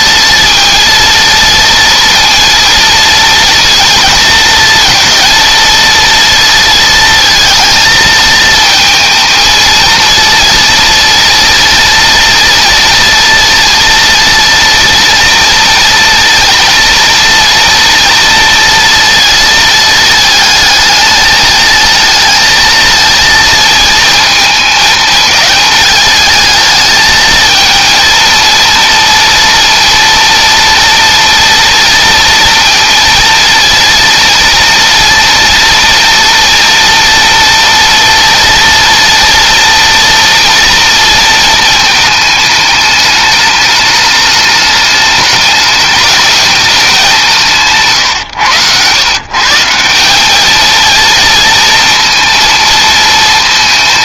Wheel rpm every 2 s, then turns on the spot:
230, 230, 230, 230, 230, 240, 230, 230, 230, 230, 220, 220, 220, 220, 230, 230, 230, 240, 230, 230, 230, 210, 210, 190, 140, 230, 220.
none